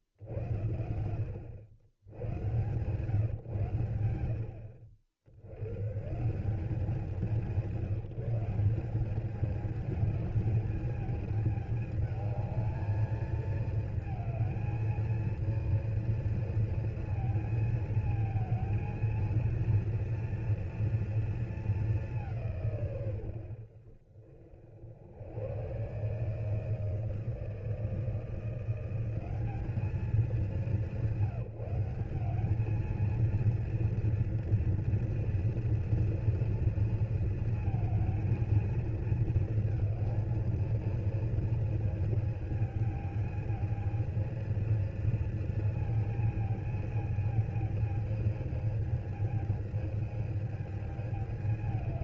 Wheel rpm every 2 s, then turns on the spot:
100, 60, 130, 170, 220, 210, 220, 230, 220, 230, 210, 60, 140, 160, 210, 190, 230, 240, 230, 220, 220, 220, 230, 220, 220, 210.
none